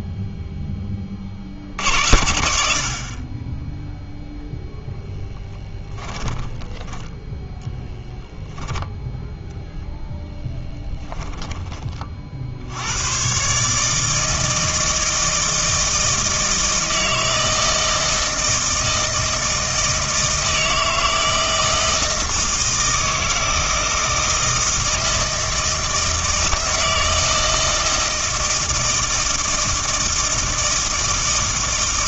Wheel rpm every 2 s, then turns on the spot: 30, 60, 10, 10, 0, 10, 90, 160, 160, 160, 160, 160, 160, 160, 160, 160.
6-8 10-12